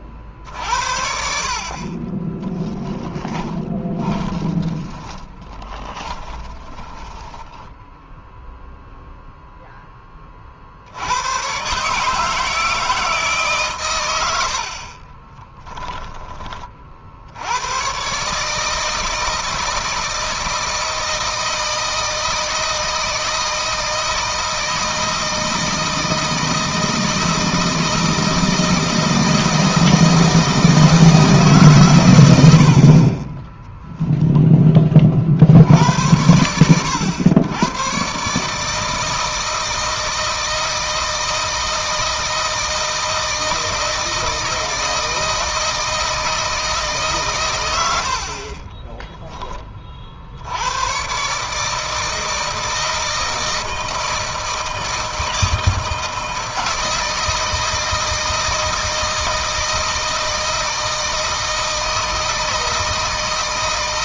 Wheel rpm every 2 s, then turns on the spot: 60, 20, 20, 10, 0, 70, 160, 50, 50, 160, 160, 160, 160, 160, 160, 160, 60, 20, 100, 160, 160, 160, 160, 150, 20, 110, 160, 160, 160, 160, 160, 160.
2-8 14-16 48-50